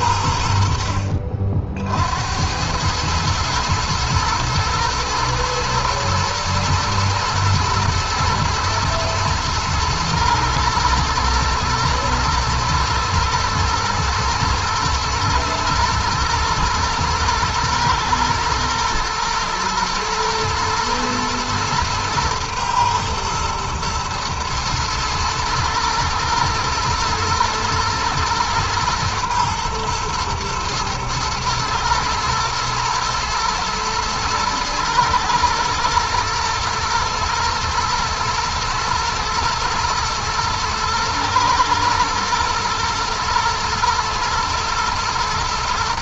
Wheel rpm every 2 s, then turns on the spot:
50, 110, 120, 110, 120, 120, 120, 120, 110, 110, 110, 120, 110, 120, 120, 110, 110, 110, 120, 110, 110, 110, 110.
none